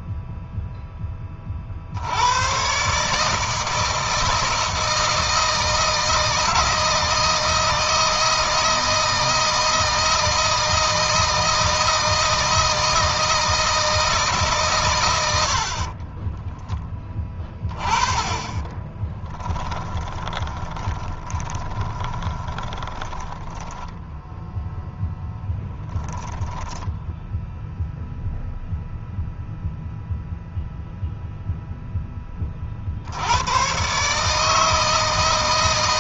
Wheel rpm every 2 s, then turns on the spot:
10, 130, 160, 160, 160, 160, 160, 120, 10, 10, 20, 10, 0, 10, 0, 0, 50, 160.
18-24 26-28